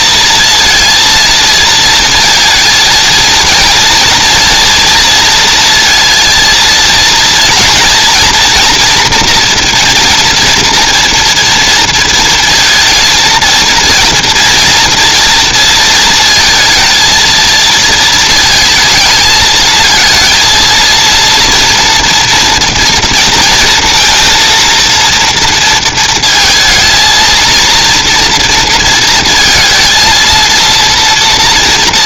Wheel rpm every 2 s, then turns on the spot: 230, 230, 230, 230, 240, 240, 230, 230, 220, 220, 230, 230, 230, 230, 230, 230.
none